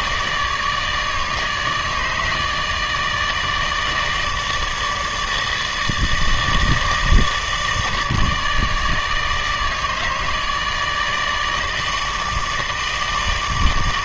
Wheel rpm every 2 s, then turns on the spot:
150, 160, 160, 160, 150, 150, 150.
none